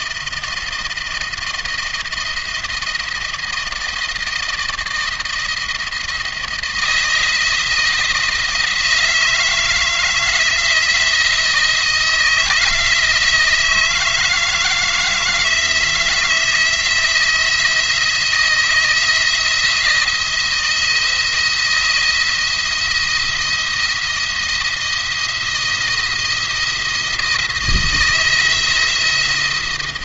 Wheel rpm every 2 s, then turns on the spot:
160, 170, 160, 170, 160, 160, 170, 160, 160, 170, 170, 170, 170, 170, 170.
none